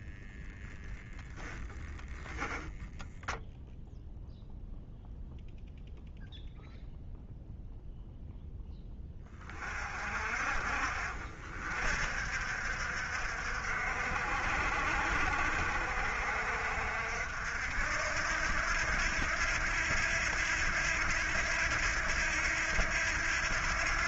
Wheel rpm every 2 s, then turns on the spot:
10, 0, 0, 0, 20, 50, 60, 60, 60, 80, 80, 80.
0-2